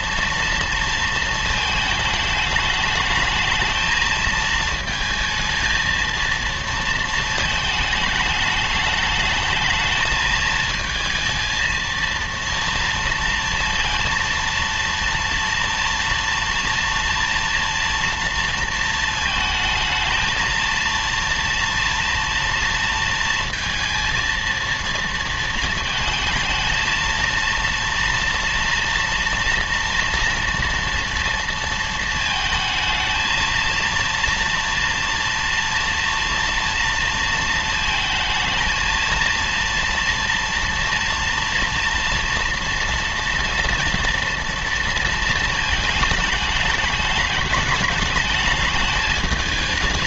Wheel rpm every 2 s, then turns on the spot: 230, 210, 230, 230, 210, 220, 230, 230, 230, 230, 230, 230, 230, 230, 230, 230, 220, 230, 230, 220, 230, 230, 230, 210, 210.
none